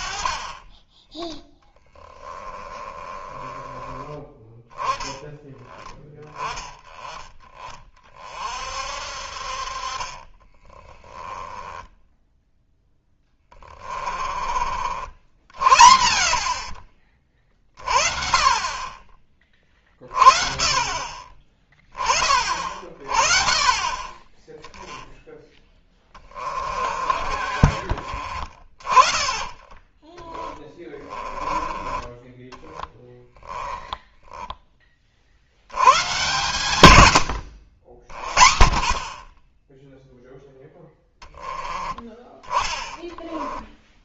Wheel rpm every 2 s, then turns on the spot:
20, 20, 10, 10, 40, 20, 10, 40, 40, 30, 40, 40, 10, 30, 30, 20, 10, 20, 110, 50, 0, 10.
2-4 10-12 26-28 30-34 42-44